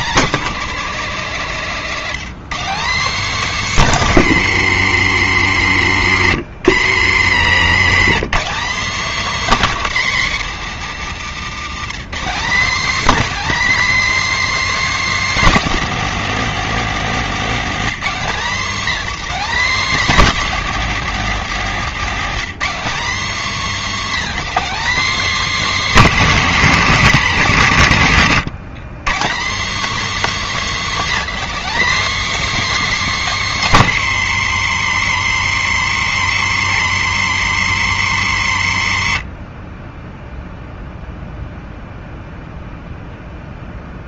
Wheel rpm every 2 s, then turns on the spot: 240, 230, 170, 120, 230, 190, 240, 290, 230, 230, 240, 220, 270, 220, 170, 260, 290, 160, 150, 100, 0, 0.
none